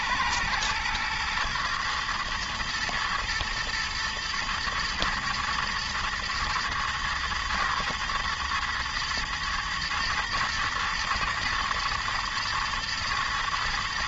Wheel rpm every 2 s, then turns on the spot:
110, 110, 120, 110, 110, 110, 110.
none